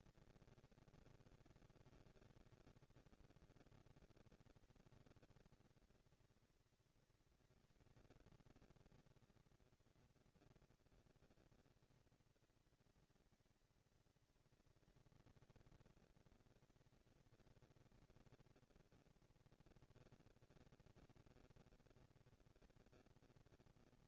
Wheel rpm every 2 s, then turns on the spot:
230, 220, 230, 230, 230, 230, 230, 230, 230, 230, 230, 230.
none